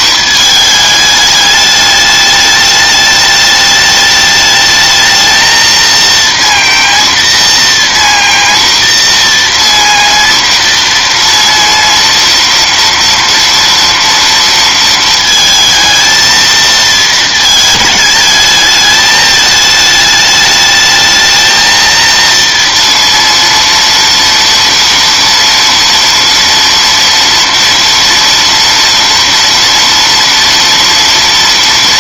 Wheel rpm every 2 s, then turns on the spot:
220, 210, 220, 230, 230, 230, 230, 230, 220, 210, 210, 230, 230, 230, 230, 230.
none